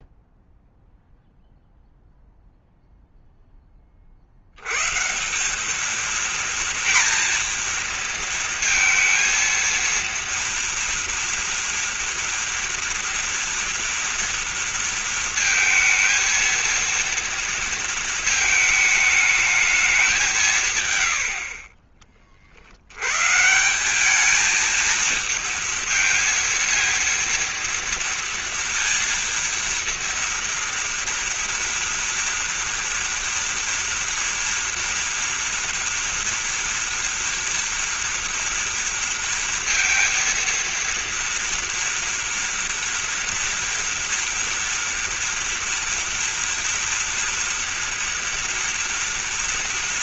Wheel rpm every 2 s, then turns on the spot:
0, 0, 100, 230, 230, 230, 230, 230, 230, 220, 160, 60, 220, 230, 230, 230, 230, 240, 240, 230, 230, 230, 230, 230, 230.
none